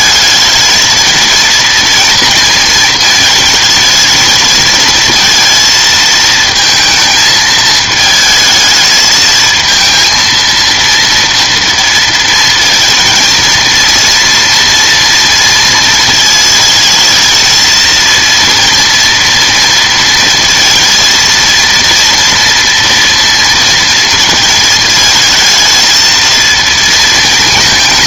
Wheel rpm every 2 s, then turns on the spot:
220, 230, 220, 220, 220, 230, 230, 230, 220, 230, 230, 230, 220, 230.
none